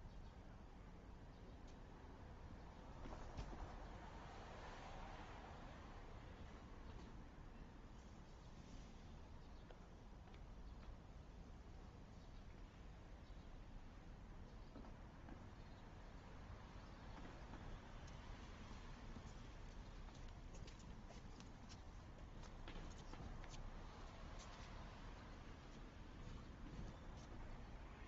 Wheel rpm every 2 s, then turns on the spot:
0, 0, 0, 0, 0, 0, 0, 0, 0, 0, 0, 0, 0, 0.
none